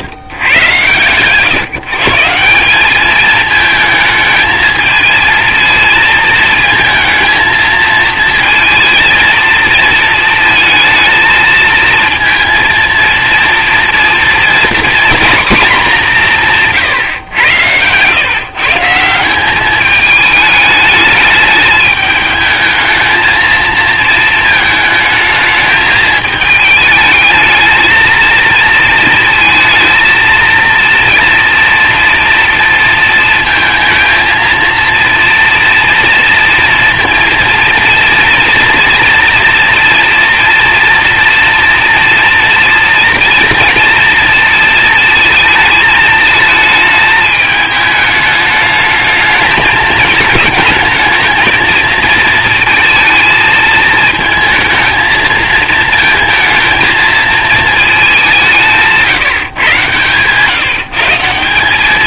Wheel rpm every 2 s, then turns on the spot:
120, 190, 220, 220, 230, 230, 230, 230, 150, 150, 210, 210, 220, 220, 230, 230, 230, 230, 230, 230, 230, 240, 230, 220, 210, 220, 230, 230, 230, 170, 150.
16-18